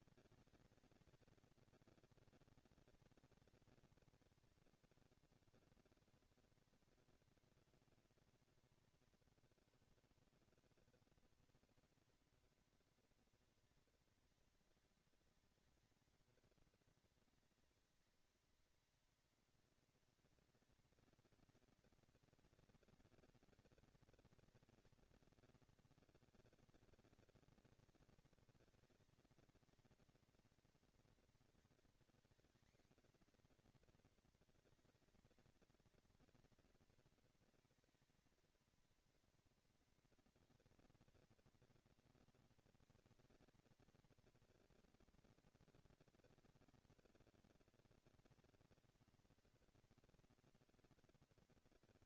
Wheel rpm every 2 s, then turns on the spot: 210, 230, 170, 220, 140, 200, 230, 220, 220, 220, 220, 220, 230, 220, 230, 230, 240, 220, 220, 230, 230, 230, 230, 230, 230, 230.
none